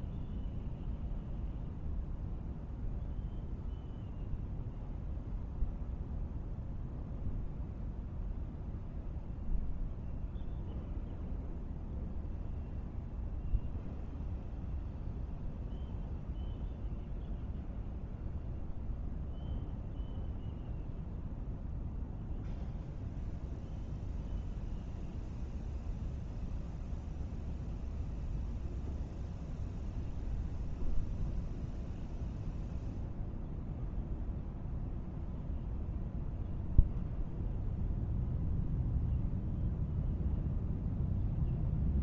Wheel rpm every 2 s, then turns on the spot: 0, 0, 0, 0, 0, 0, 0, 0, 0, 0, 0, 0, 0, 0, 0, 0, 0, 0, 0, 0, 0.
none